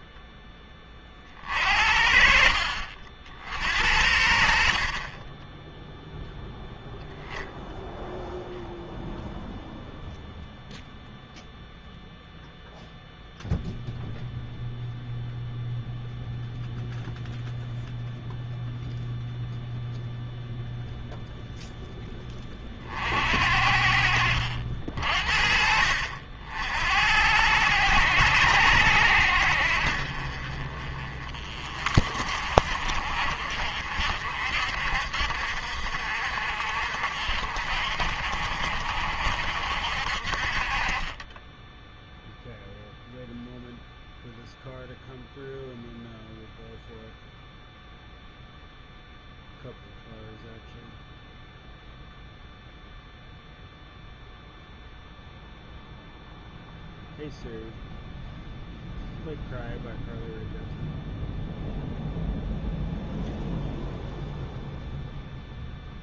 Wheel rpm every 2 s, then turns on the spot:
20, 50, 60, 0, 0, 0, 0, 0, 0, 0, 0, 30, 60, 60, 80, 40, 50, 60, 60, 60, 40, 0, 0, 0, 0, 0, 0, 0, 0, 0, 0, 0, 0.
none